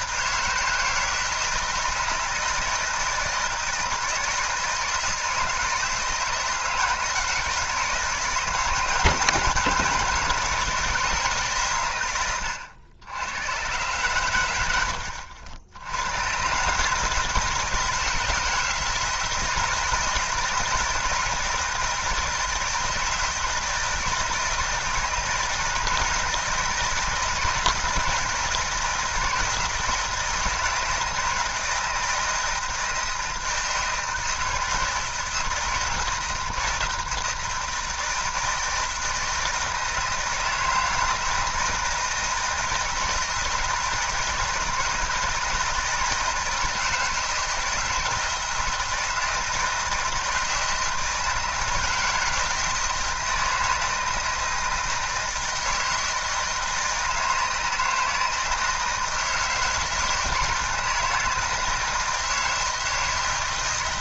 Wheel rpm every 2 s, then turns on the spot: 160, 160, 160, 160, 160, 170, 90, 90, 130, 160, 170, 160, 160, 160, 160, 160, 160, 160, 160, 160, 160, 160, 160, 160, 160, 160, 160, 160, 160, 160, 160, 160.
none